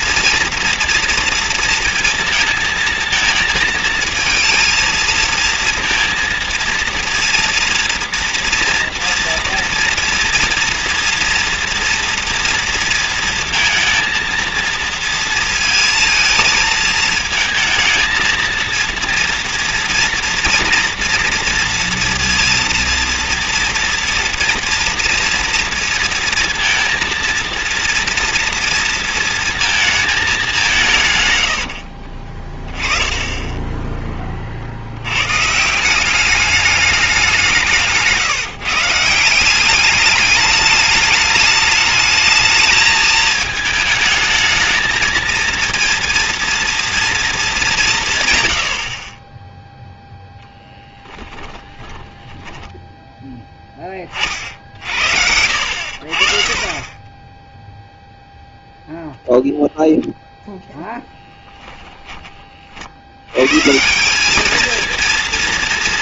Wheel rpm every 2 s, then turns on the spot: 230, 230, 230, 230, 230, 230, 230, 230, 220, 230, 230, 230, 230, 230, 230, 200, 20, 50, 210, 150, 210, 220, 220, 230, 70, 10, 10, 50, 30, 0, 0, 40, 220.
none